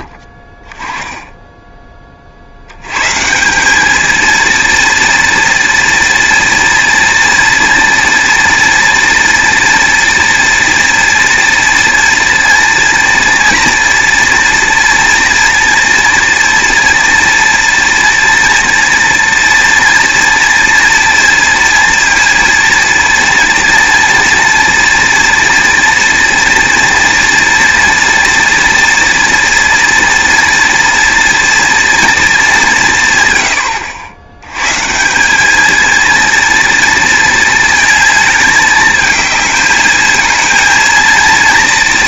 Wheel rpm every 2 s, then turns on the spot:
10, 90, 230, 230, 230, 230, 230, 230, 230, 230, 230, 230, 230, 240, 230, 230, 190, 130, 230, 220, 230.
none